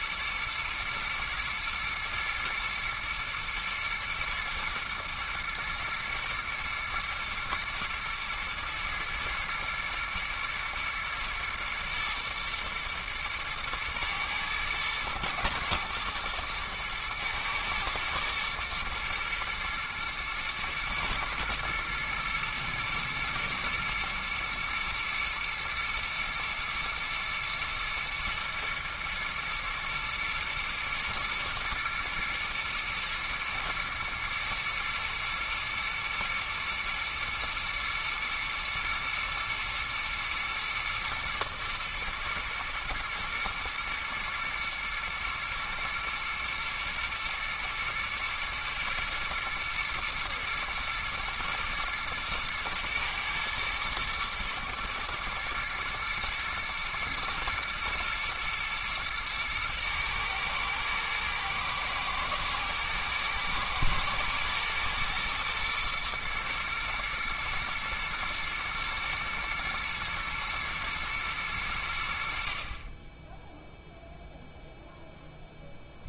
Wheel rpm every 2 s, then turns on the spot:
120, 110, 110, 110, 120, 120, 120, 120, 120, 120, 120, 120, 110, 120, 120, 110, 110, 120, 110, 120, 120, 110, 120, 120, 110, 110, 110, 120, 110, 120, 110, 110, 120, 110, 120, 110, 50, 0.
none